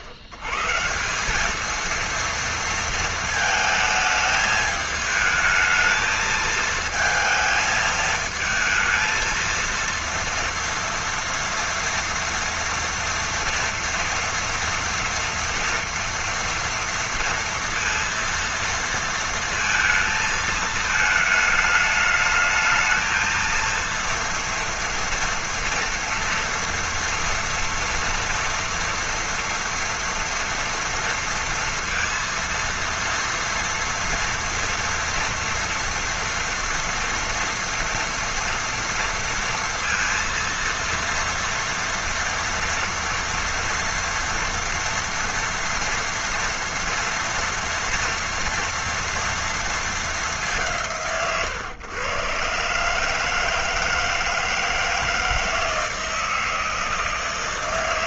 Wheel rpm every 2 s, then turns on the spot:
110, 230, 220, 220, 220, 230, 230, 230, 230, 230, 220, 220, 230, 230, 230, 230, 230, 230, 230, 230, 230, 230, 230, 230, 230, 160, 140, 160, 160.
none